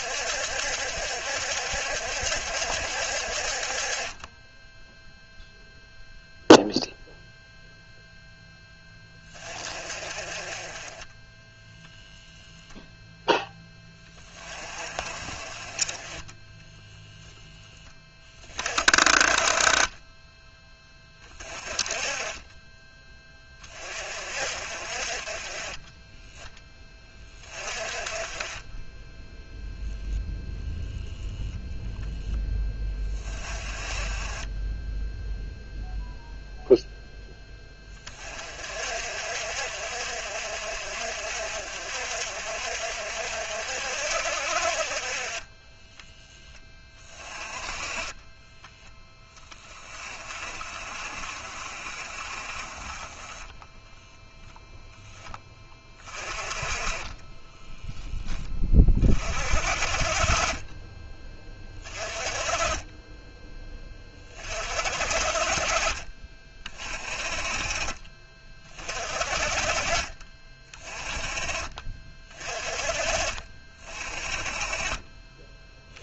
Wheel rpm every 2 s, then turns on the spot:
70, 60, 0, 0, 10, 20, 0, 30, 10, 30, 20, 20, 40, 20, 20, 0, 20, 10, 0, 50, 50, 60, 40, 20, 10, 40, 20, 0, 20, 30, 20, 20, 40, 30, 30, 20, 30, 30.
56-58